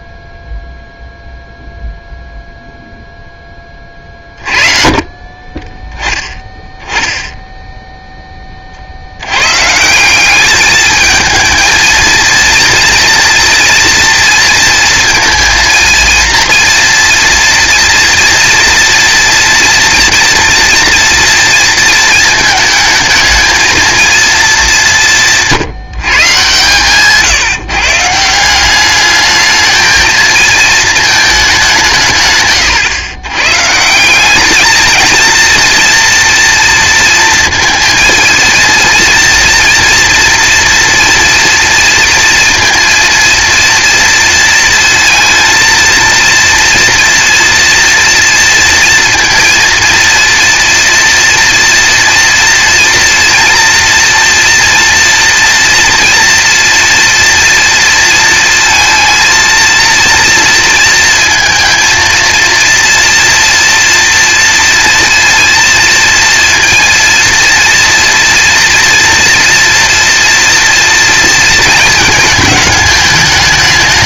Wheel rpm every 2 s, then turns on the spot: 0, 0, 40, 10, 30, 210, 230, 230, 230, 240, 230, 220, 210, 140, 180, 230, 150, 200, 230, 230, 230, 230, 230, 230, 230, 230, 230, 230, 240, 230, 230, 230, 230, 230, 230, 230, 220.
none